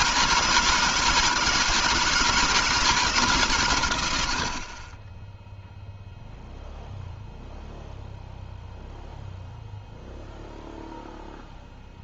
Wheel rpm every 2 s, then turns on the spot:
160, 160, 20, 0, 0, 0.
none